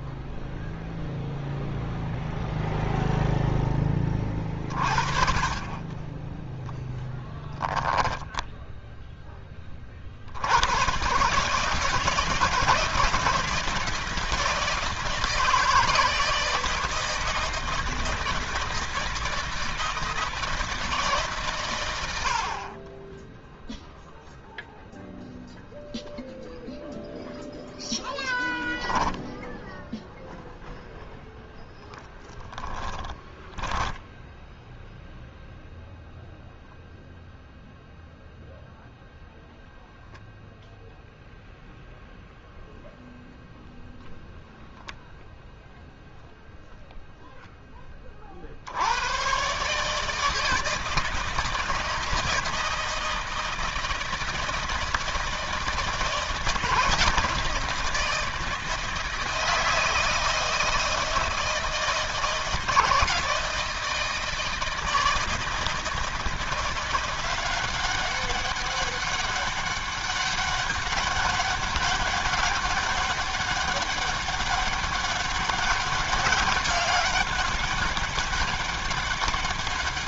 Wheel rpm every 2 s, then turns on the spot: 0, 0, 30, 10, 10, 90, 160, 160, 160, 160, 160, 60, 0, 0, 0, 0, 10, 0, 0, 0, 0, 0, 0, 0, 60, 160, 160, 160, 160, 160, 160, 160, 160, 170, 200, 200, 200, 200, 190, 200.
32-34